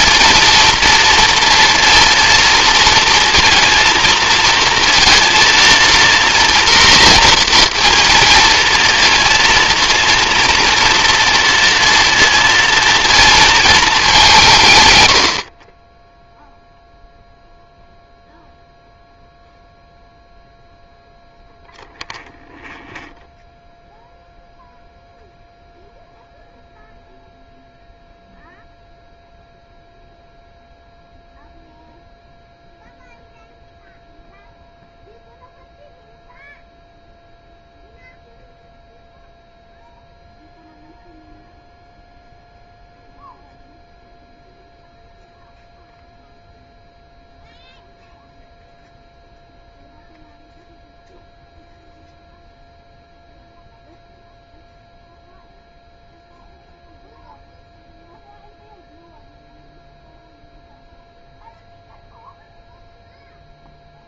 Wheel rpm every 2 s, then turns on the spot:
240, 230, 230, 240, 230, 230, 230, 120, 0, 0, 0, 0, 0, 0, 0, 0, 0, 0, 0, 0, 0, 0, 0, 0, 0, 0, 0, 0, 0, 0, 0, 0.
none